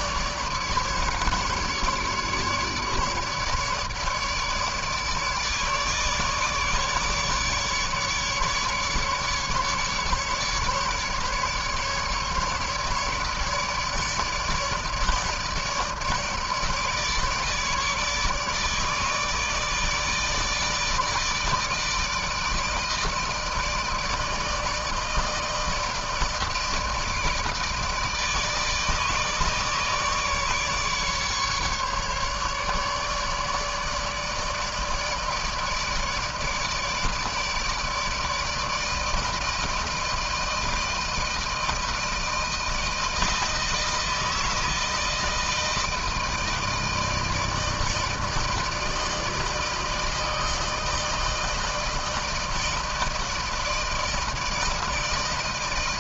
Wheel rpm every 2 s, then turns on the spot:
150, 150, 150, 150, 150, 150, 150, 160, 150, 150, 160, 160, 160, 160, 160, 150, 150, 150, 150, 160, 160, 160, 160, 160, 160, 160, 160, 160.
none